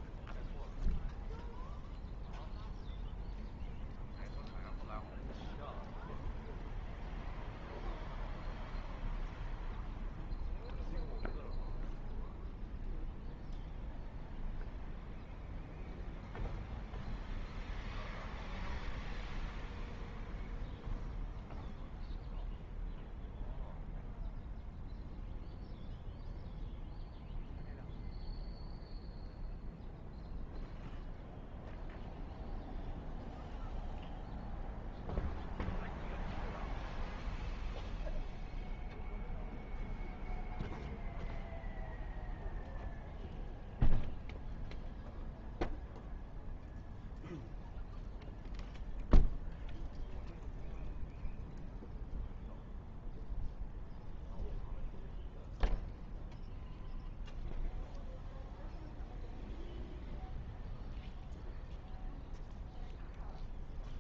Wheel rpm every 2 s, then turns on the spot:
0, 0, 0, 0, 0, 0, 0, 0, 0, 0, 0, 0, 0, 0, 0, 0, 0, 0, 0, 0, 0, 0, 0, 0, 0, 0, 0, 0, 0, 0, 0, 0.
none